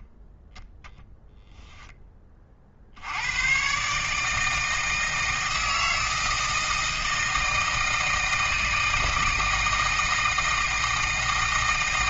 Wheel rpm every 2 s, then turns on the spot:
0, 50, 160, 160, 160, 160.
none